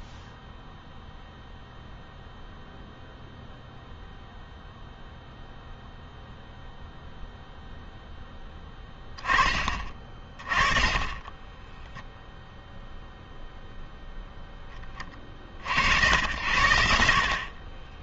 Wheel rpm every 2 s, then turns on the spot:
0, 0, 0, 0, 10, 20, 0, 10, 80.
none